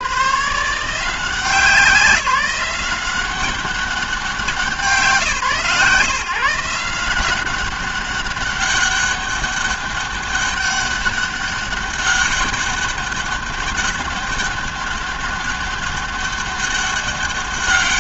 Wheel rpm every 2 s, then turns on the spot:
140, 180, 180, 170, 200, 200, 200, 200, 200.
none